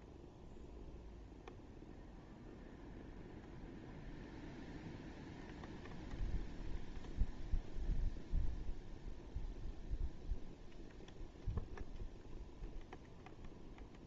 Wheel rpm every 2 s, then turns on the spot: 0, 0, 0, 0, 0, 0, 0.
none